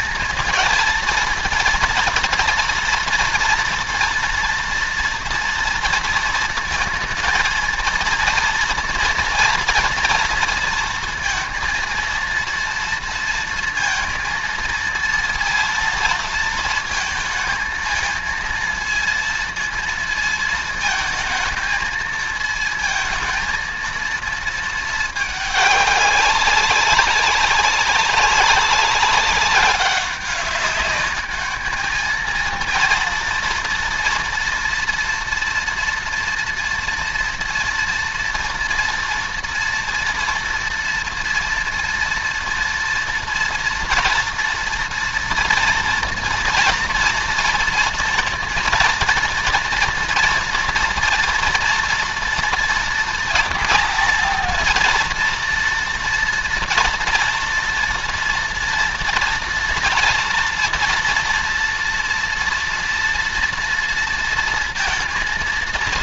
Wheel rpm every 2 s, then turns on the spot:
230, 230, 240, 230, 230, 230, 230, 230, 230, 230, 230, 220, 230, 200, 200, 190, 220, 230, 230, 230, 230, 230, 230, 230, 230, 240, 230, 230, 230, 230, 230, 230, 230.
none